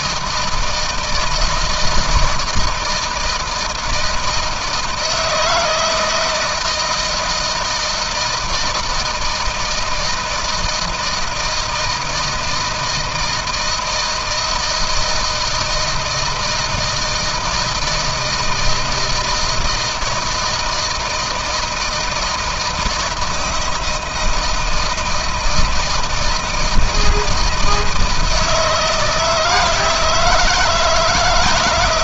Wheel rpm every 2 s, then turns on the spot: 160, 160, 160, 160, 160, 160, 160, 160, 160, 160, 160, 160, 160, 160, 160, 160.
none